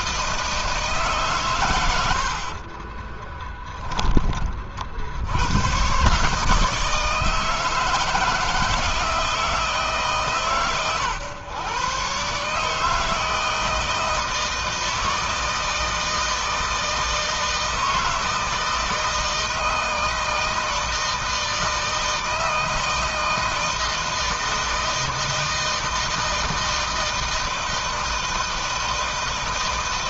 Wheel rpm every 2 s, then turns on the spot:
160, 50, 40, 150, 160, 140, 150, 160, 160, 160, 160, 160, 160, 160, 160.
2-4